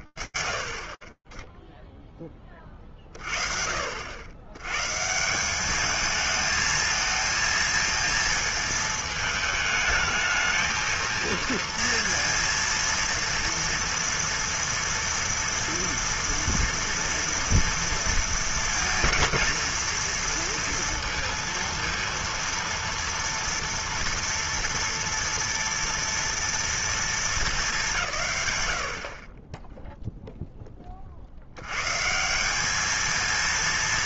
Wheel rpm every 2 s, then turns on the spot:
40, 50, 180, 230, 220, 230, 230, 240, 230, 230, 230, 230, 230, 210, 30, 40, 210.
none